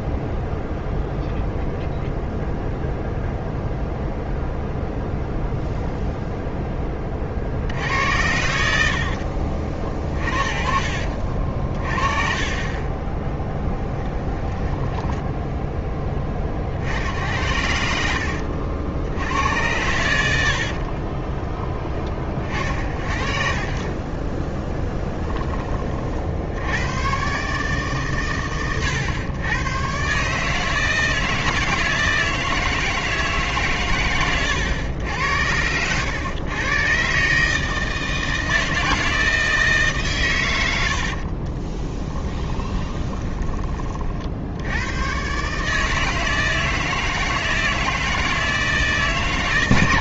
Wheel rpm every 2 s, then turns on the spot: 0, 0, 0, 30, 80, 50, 30, 10, 60, 90, 40, 30, 10, 90, 110, 160, 160, 100, 130, 160, 90, 20, 100, 160, 160.
8-10 12-16 20-22 24-26 42-44